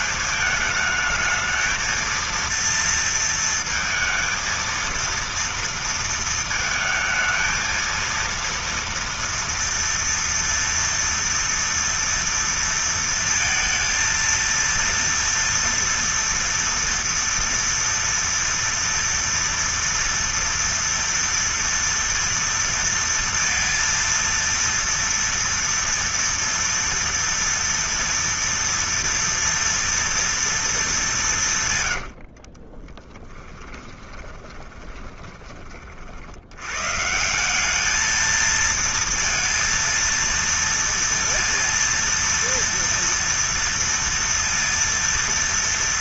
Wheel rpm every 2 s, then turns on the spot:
220, 230, 230, 220, 230, 230, 230, 230, 230, 230, 230, 230, 230, 230, 230, 210, 30, 20, 120, 230, 230, 230, 230.
32-36